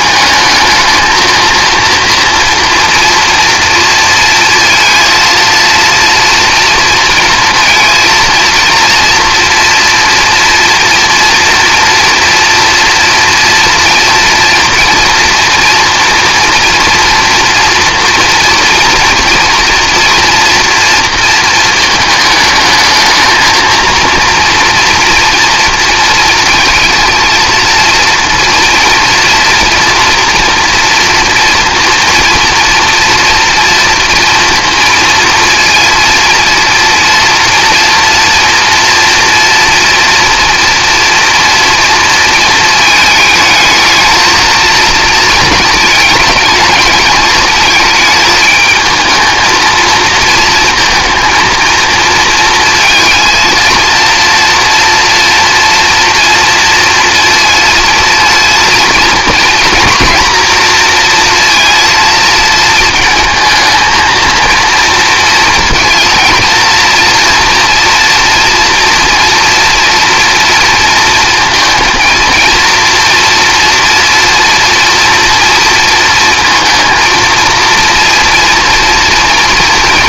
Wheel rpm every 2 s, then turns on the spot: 220, 230, 230, 230, 230, 230, 240, 230, 230, 230, 230, 220, 230, 230, 230, 230, 230, 230, 230, 240, 230, 220, 220, 220, 220, 230, 230, 230, 230, 230, 230, 220, 230, 230, 230, 230, 230, 230, 230, 230.
none